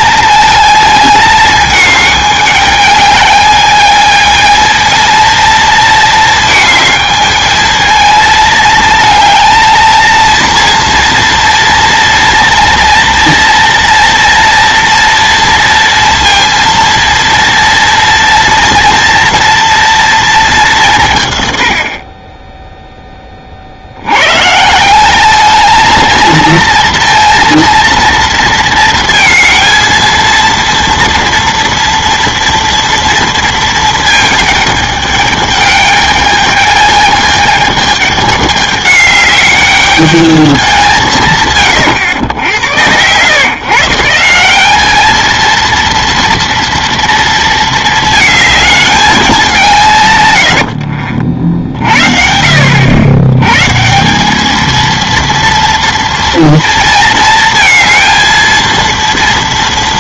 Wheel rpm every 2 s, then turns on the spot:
220, 210, 230, 220, 220, 230, 230, 230, 230, 230, 200, 10, 160, 230, 230, 230, 230, 210, 210, 200, 200, 100, 190, 230, 220, 80, 70, 220, 230, 230.
50-52